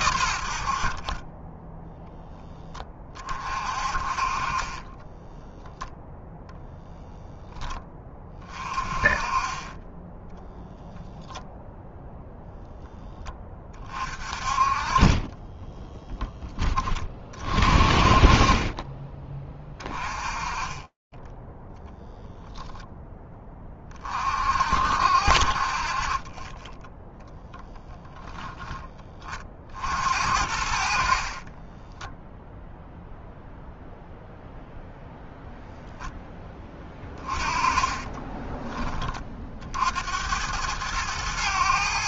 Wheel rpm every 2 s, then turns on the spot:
70, 10, 30, 0, 20, 0, 0, 30, 10, 30, 20, 0, 50, 20, 0, 70, 0, 0, 10, 30, 90.
38-40